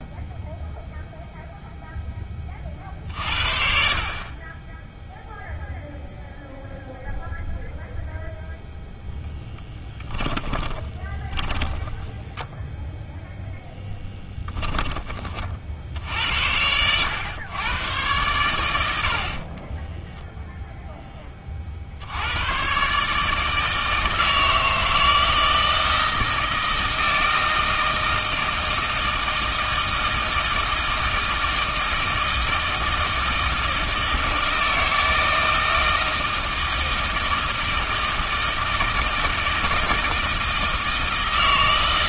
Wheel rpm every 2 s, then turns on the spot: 0, 40, 20, 0, 0, 20, 0, 20, 90, 90, 0, 120, 160, 160, 160, 160, 160, 160, 160, 160, 160.
10-12